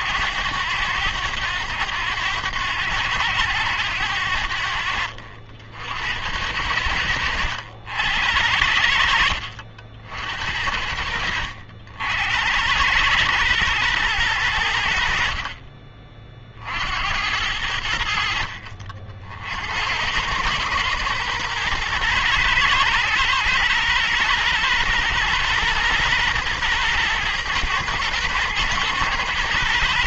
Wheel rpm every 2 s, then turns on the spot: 90, 90, 70, 90, 70, 60, 100, 80, 70, 50, 110, 110, 120, 120, 110.
none